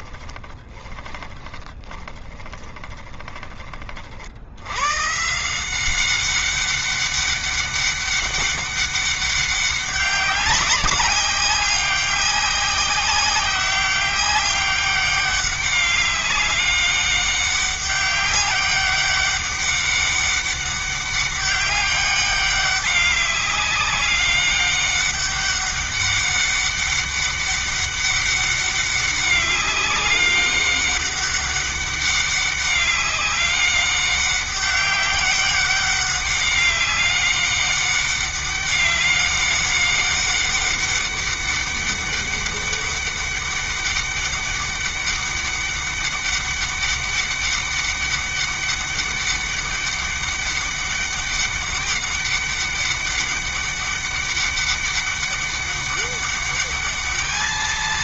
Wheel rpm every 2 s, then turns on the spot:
20, 20, 110, 200, 200, 190, 190, 200, 200, 200, 200, 200, 200, 200, 200, 200, 190, 200, 200, 200, 200, 200, 200, 200, 200, 200, 200, 200, 210.
0-4